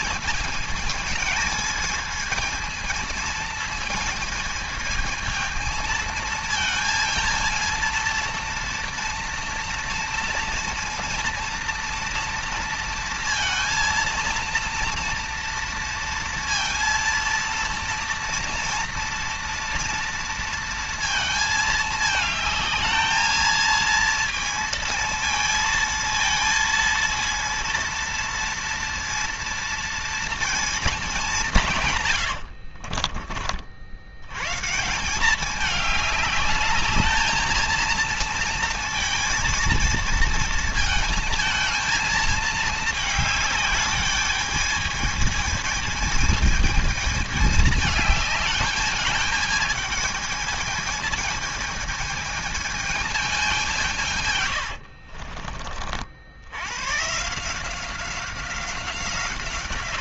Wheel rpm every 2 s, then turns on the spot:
220, 220, 220, 220, 230, 230, 230, 230, 230, 230, 230, 220, 230, 230, 230, 230, 80, 140, 210, 230, 230, 220, 210, 220, 210, 220, 220, 100, 90, 180.
32-34 54-56